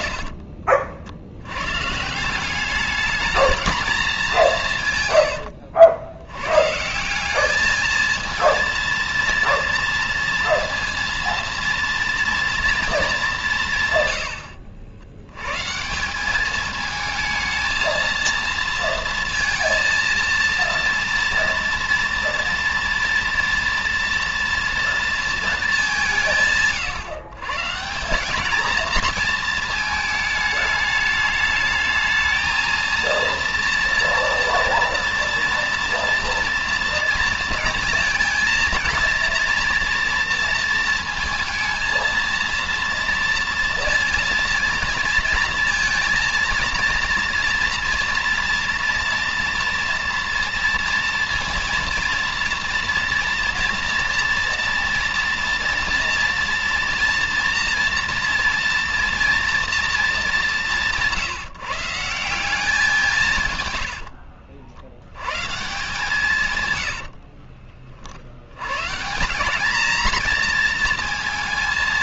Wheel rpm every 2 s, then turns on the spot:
60, 180, 200, 110, 230, 230, 230, 90, 200, 230, 230, 230, 230, 150, 200, 210, 220, 230, 230, 230, 230, 230, 230, 230, 240, 230, 230, 230, 230, 230, 210, 180, 70, 140, 80, 230.
0-2 64-66